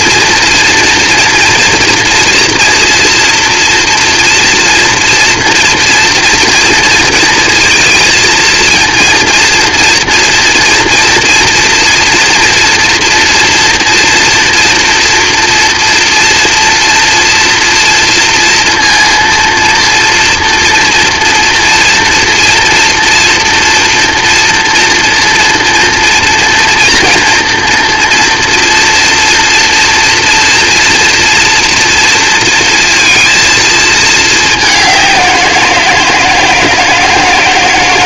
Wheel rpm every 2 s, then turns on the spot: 230, 230, 230, 230, 230, 230, 230, 230, 230, 230, 230, 230, 230, 230, 230, 230, 230, 210, 160.
none